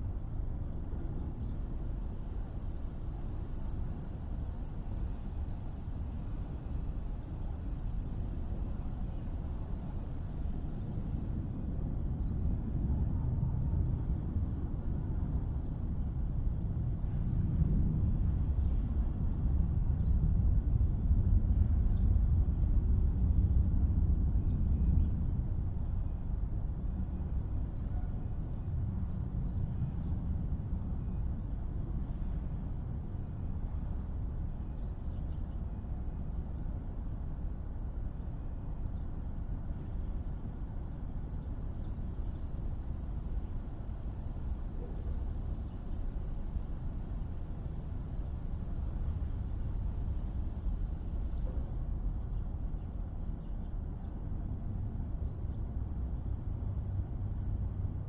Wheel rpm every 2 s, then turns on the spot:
0, 0, 0, 0, 0, 0, 0, 0, 0, 0, 0, 0, 0, 0, 0, 0, 0, 0, 0, 0, 0, 0, 0, 0, 0, 0, 0, 0, 0.
none